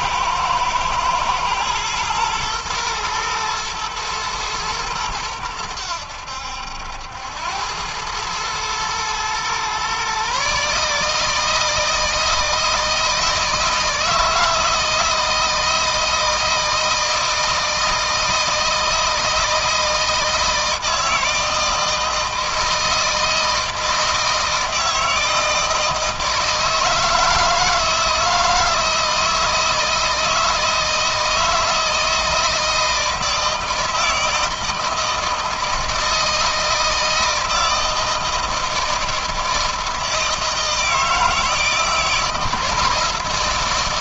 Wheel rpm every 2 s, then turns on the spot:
110, 120, 110, 80, 110, 150, 160, 160, 160, 160, 160, 160, 160, 160, 160, 160, 160, 160, 160, 160, 160, 170.
none